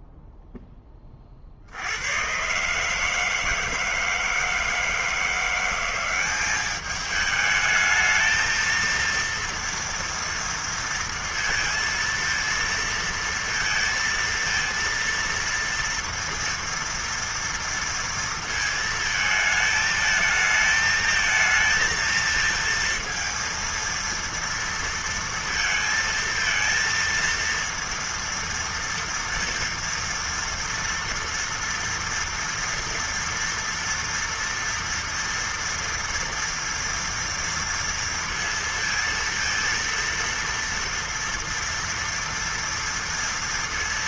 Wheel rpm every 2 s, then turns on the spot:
0, 130, 160, 200, 220, 230, 230, 230, 230, 230, 220, 230, 230, 230, 230, 230, 230, 240, 230, 230, 230, 230.
none